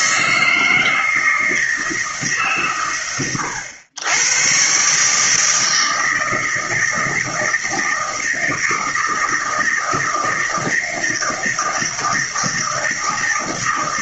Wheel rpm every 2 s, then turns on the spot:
160, 120, 140, 160, 160, 160, 160.
none